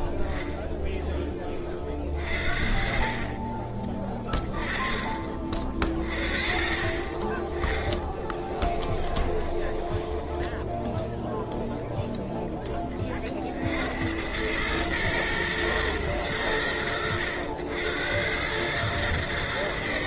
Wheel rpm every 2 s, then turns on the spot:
10, 40, 20, 40, 10, 10, 10, 100, 90, 100.
8-12